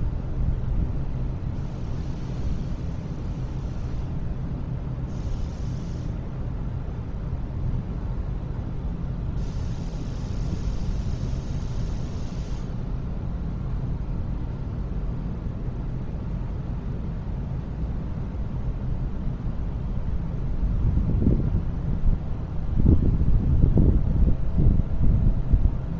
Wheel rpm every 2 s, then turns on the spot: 0, 0, 0, 0, 0, 0, 0, 0, 0, 0, 0, 0, 0.
none